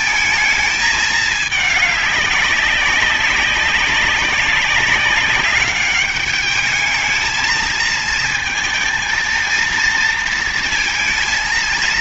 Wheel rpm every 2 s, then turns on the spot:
220, 200, 190, 210, 230, 230.
none